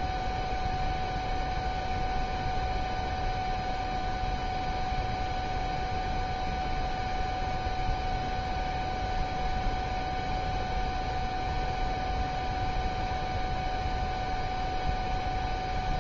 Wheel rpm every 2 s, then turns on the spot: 0, 0, 0, 0, 0, 0, 0, 0.
none